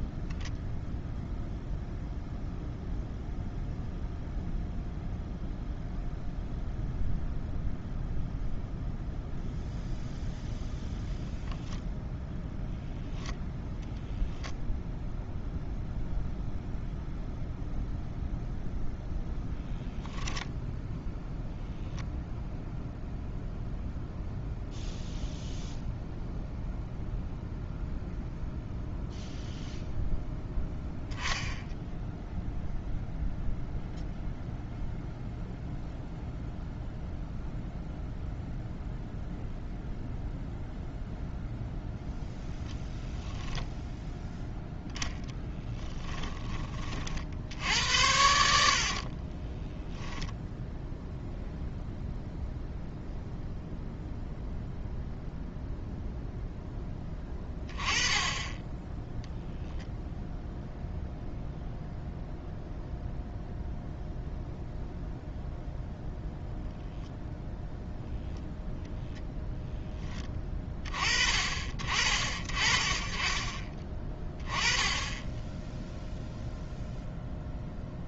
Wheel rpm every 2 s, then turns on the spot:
0, 0, 0, 0, 0, 0, 0, 0, 0, 0, 0, 0, 0, 0, 0, 10, 0, 0, 0, 0, 0, 0, 10, 40, 60, 0, 0, 0, 0, 10, 0, 0, 0, 0, 0, 30, 30, 10, 0.
none